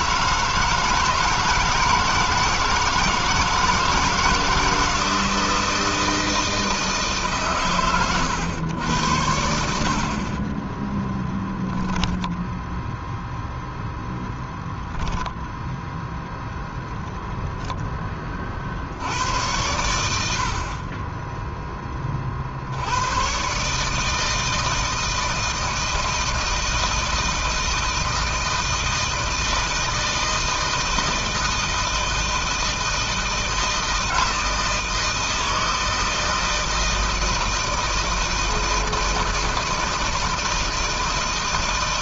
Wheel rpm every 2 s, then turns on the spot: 160, 160, 160, 160, 100, 10, 0, 0, 0, 70, 30, 90, 160, 160, 160, 160, 160, 160, 160, 160, 160.
10-12